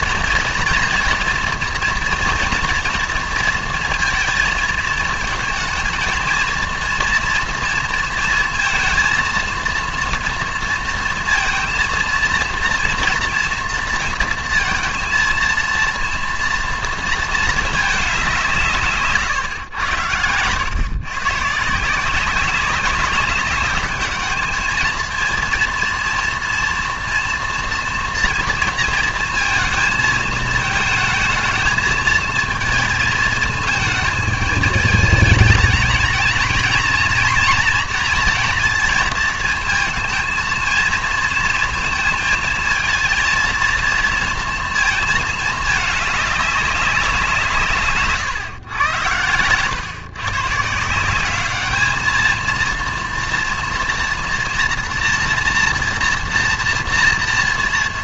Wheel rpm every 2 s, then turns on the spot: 230, 230, 220, 230, 230, 230, 230, 230, 230, 160, 120, 200, 220, 230, 230, 220, 220, 210, 220, 230, 230, 230, 230, 200, 120, 150, 230, 230, 240.
none